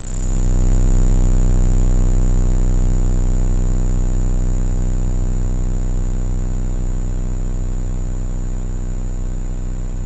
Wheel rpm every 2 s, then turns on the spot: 0, 0, 0, 0, 0.
none